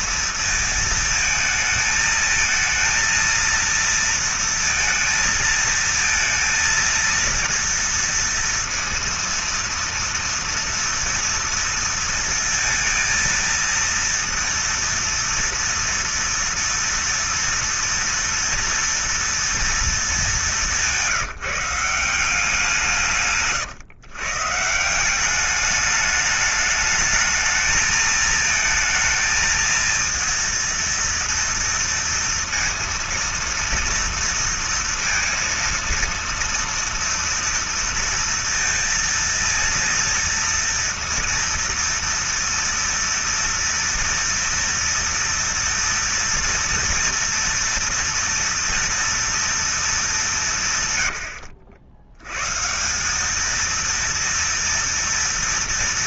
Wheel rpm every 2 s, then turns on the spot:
230, 220, 230, 230, 230, 230, 230, 230, 230, 230, 220, 180, 150, 210, 220, 230, 230, 230, 230, 230, 230, 230, 240, 230, 240, 210, 110, 230.
none